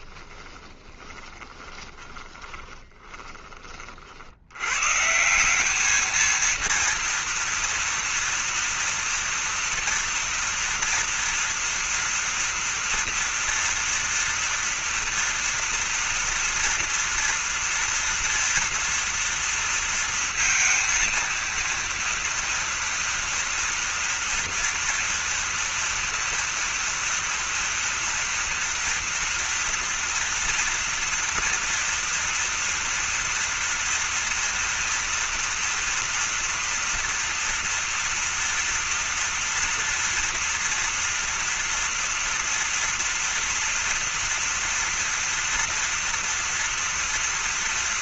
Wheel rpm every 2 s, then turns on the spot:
20, 20, 100, 230, 230, 230, 230, 230, 240, 230, 230, 230, 240, 230, 230, 230, 230, 230, 230, 230, 230, 230, 230, 230.
0-4